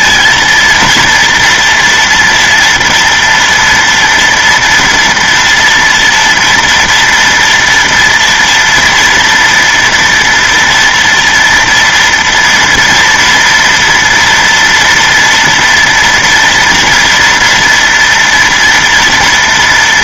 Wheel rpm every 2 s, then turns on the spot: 230, 230, 230, 240, 230, 240, 230, 230, 230, 230.
none